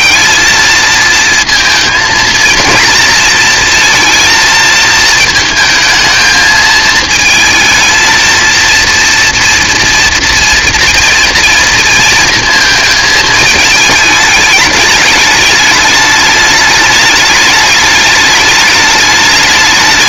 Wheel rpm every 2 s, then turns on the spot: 230, 230, 220, 220, 230, 230, 220, 210, 210, 210.
none